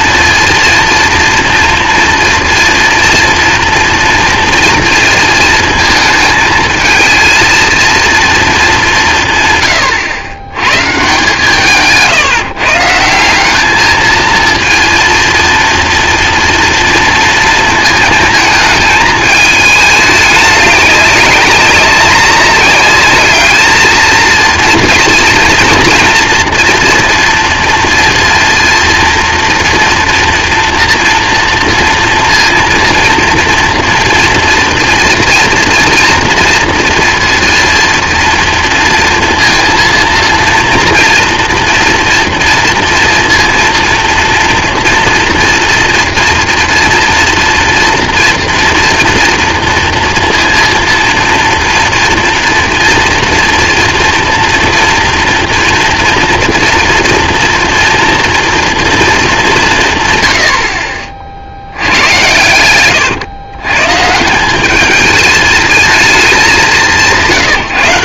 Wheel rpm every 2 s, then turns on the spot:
230, 230, 230, 220, 160, 140, 170, 230, 230, 220, 200, 210, 230, 230, 230, 230, 230, 230, 230, 230, 230, 230, 230, 240, 230, 230, 230, 230, 230, 220, 40, 130, 220, 170.
none